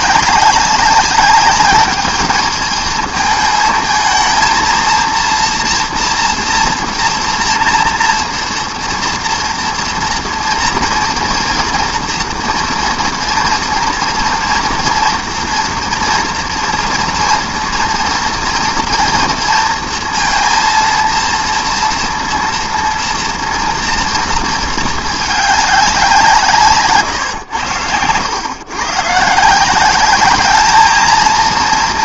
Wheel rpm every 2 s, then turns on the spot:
200, 220, 230, 230, 230, 230, 240, 240, 230, 230, 230, 230, 220, 150, 120, 220.
none